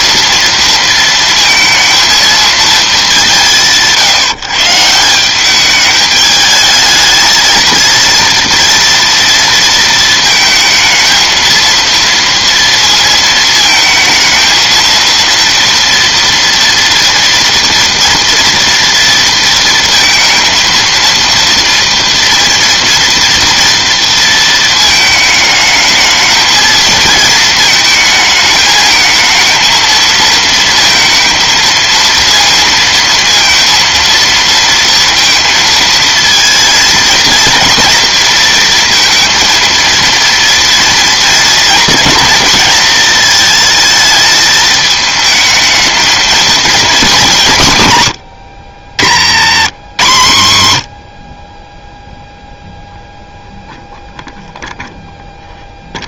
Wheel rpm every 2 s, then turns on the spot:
230, 220, 150, 220, 240, 220, 230, 230, 240, 230, 230, 230, 230, 220, 220, 230, 230, 230, 230, 230, 230, 220, 220, 220, 80, 60, 0, 0.
48-50